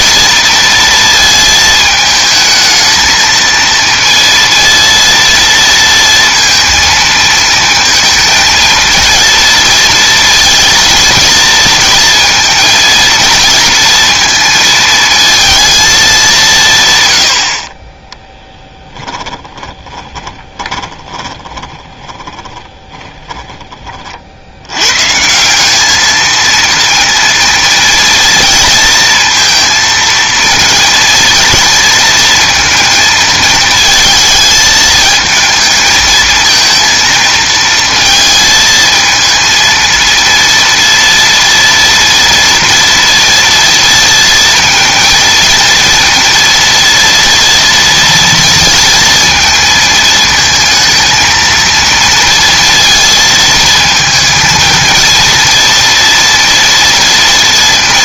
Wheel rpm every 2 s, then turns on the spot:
230, 220, 230, 230, 230, 230, 220, 230, 130, 10, 20, 20, 90, 230, 230, 230, 230, 220, 220, 220, 230, 230, 230, 230, 230, 230, 230, 230, 230.
18-24